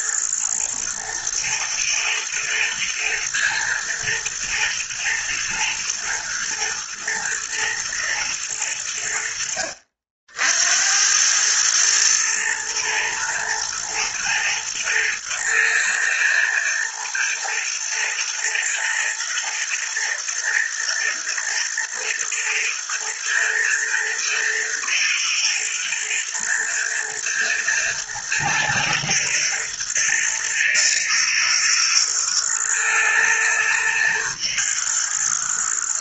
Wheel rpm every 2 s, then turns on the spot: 110, 110, 110, 120, 100, 80, 110, 110, 120, 110, 110, 120, 110, 110, 110, 120, 120, 110.
none